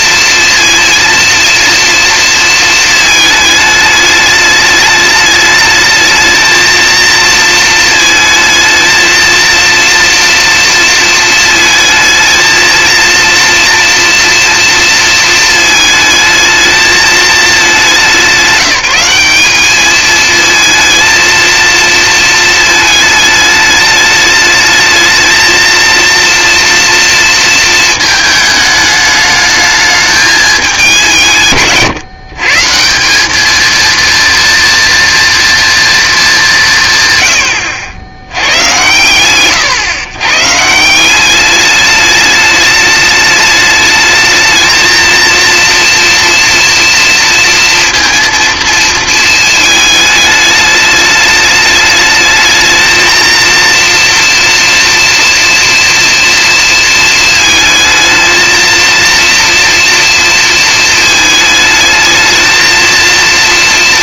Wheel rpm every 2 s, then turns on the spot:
230, 220, 210, 230, 230, 230, 230, 230, 220, 190, 230, 220, 220, 230, 210, 180, 160, 230, 160, 60, 170, 210, 230, 230, 230, 210, 220, 230, 230, 230, 220, 220.
none